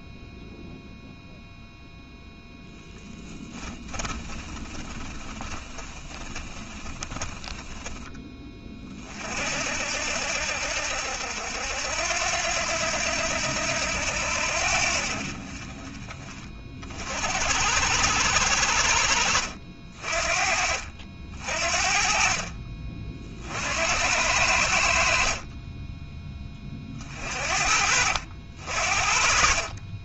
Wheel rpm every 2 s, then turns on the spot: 0, 0, 20, 20, 40, 70, 80, 60, 60, 70, 50, 40, 60, 40, 50.
4-8